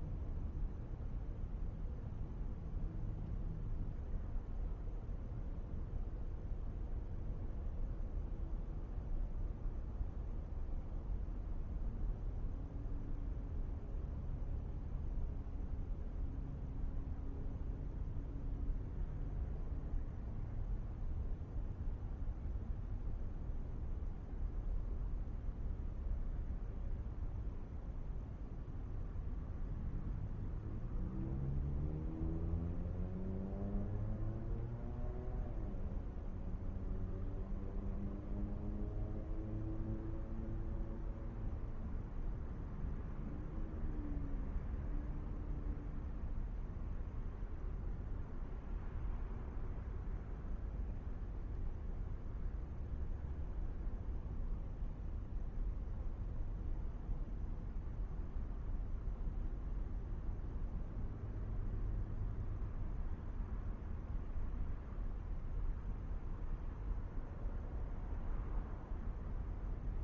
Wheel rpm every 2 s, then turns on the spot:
0, 0, 0, 0, 0, 0, 0, 0, 0, 0, 0, 0, 0, 0, 0, 0, 0, 0, 0, 0, 0, 0, 0, 0, 0, 0, 0, 0, 0, 0, 0, 0, 0, 0, 0.
none